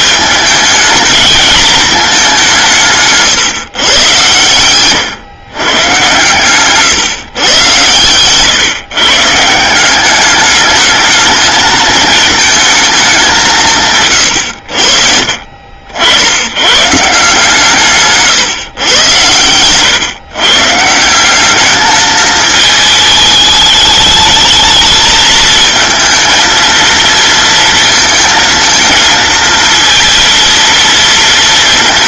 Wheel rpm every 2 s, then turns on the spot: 210, 190, 110, 140, 130, 210, 220, 90, 110, 120, 130, 220, 210, 220, 220, 230.
4-6 14-16